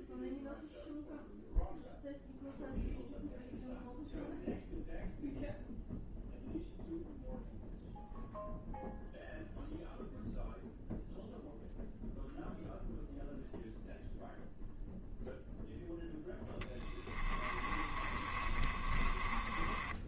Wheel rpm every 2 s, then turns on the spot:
0, 0, 0, 0, 0, 0, 0, 0, 30, 30.
16-20